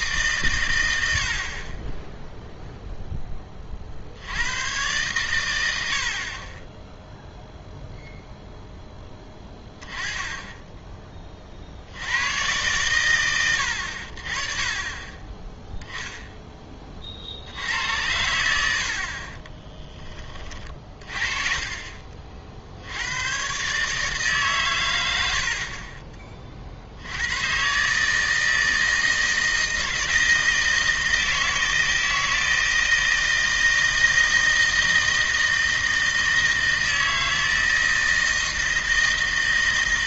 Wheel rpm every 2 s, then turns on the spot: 100, 0, 110, 20, 10, 10, 110, 30, 20, 70, 30, 70, 120, 50, 160, 160, 160, 160, 160, 160.
none